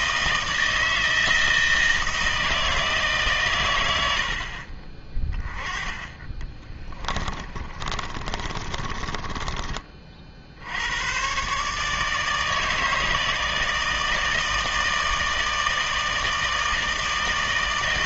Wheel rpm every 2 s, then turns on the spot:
160, 160, 40, 30, 30, 80, 160, 160, 160.
6-10